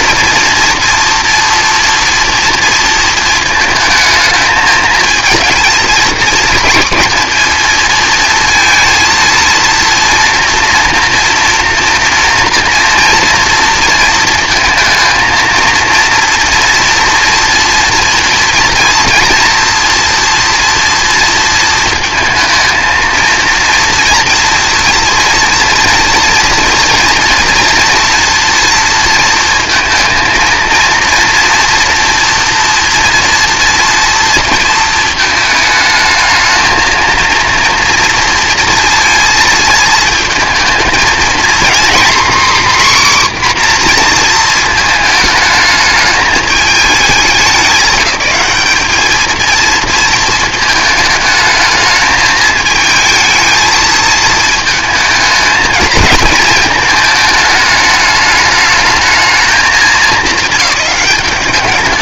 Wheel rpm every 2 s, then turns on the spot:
230, 230, 220, 240, 230, 240, 230, 230, 230, 230, 240, 230, 230, 230, 230, 230, 240, 220, 230, 230, 230, 270, 230, 220, 210, 220, 220, 220, 220, 210, 210.
none